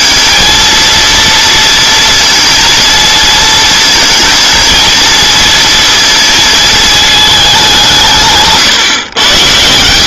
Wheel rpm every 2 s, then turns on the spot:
230, 230, 230, 220, 130.
none